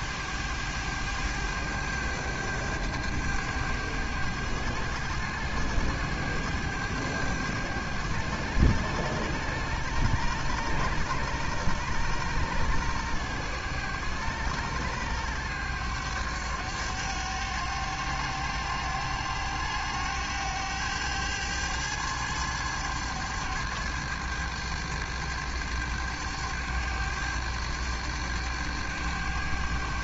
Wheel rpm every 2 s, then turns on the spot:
100, 100, 100, 100, 100, 100, 100, 100, 100, 100, 100, 100, 100, 100, 100.
none